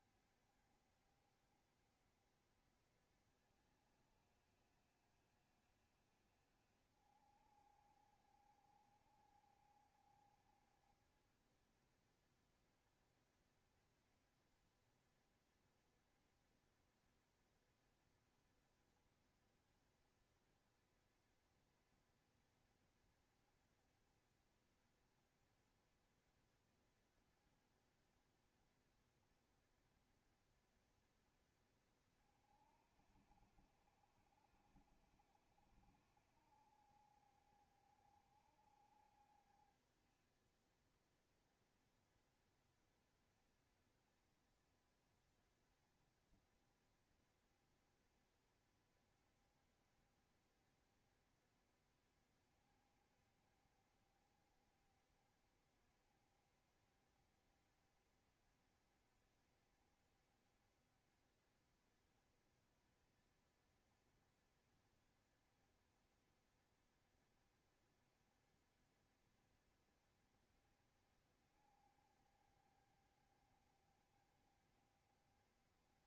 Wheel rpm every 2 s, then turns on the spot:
70, 60, 60, 60, 60, 70, 60, 60, 60, 70, 70, 70, 70, 70, 70, 70, 60, 70, 60, 70, 70, 60, 60, 60, 70, 70, 70, 60, 70, 70, 70, 70, 60, 70, 70, 70, 70, 70.
none